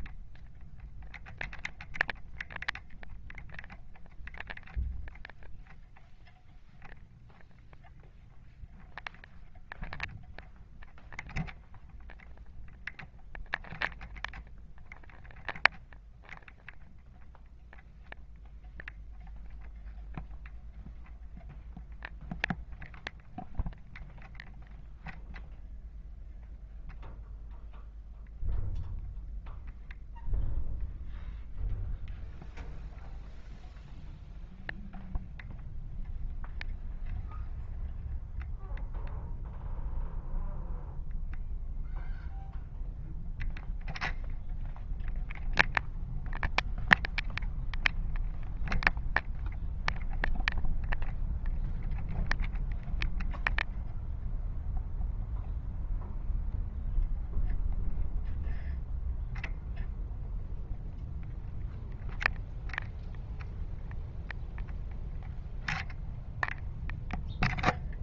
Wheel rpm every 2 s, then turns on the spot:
0, 0, 0, 0, 0, 0, 0, 0, 0, 0, 0, 0, 0, 0, 0, 0, 0, 0, 0, 0, 0, 0, 0, 0, 0, 0, 0, 0, 0, 0, 0, 0, 0, 0.
none